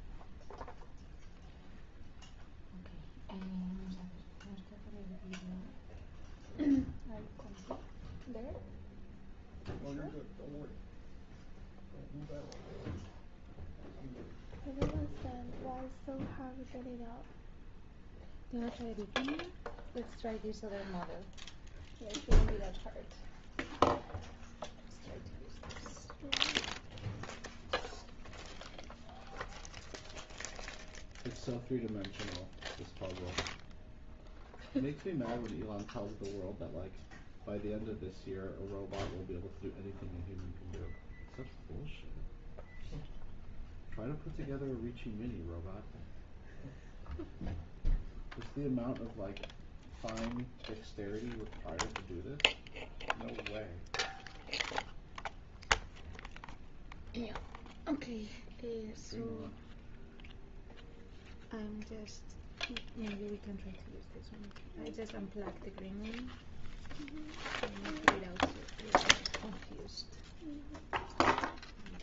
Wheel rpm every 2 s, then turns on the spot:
0, 0, 0, 0, 0, 0, 0, 0, 0, 0, 0, 0, 0, 0, 0, 0, 0, 0, 0, 0, 0, 0, 0, 0, 0, 0, 0, 0, 0, 0, 0, 0, 0, 0, 0, 0.
none